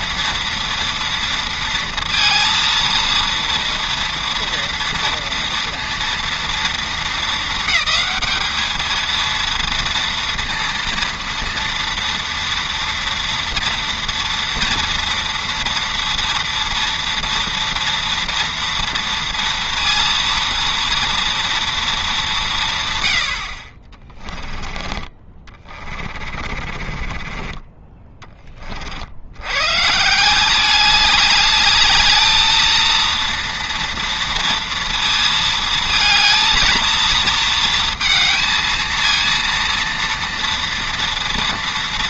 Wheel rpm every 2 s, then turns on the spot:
230, 230, 230, 230, 220, 230, 230, 230, 230, 230, 230, 150, 20, 30, 40, 200, 220, 230, 230, 230, 230.
24-28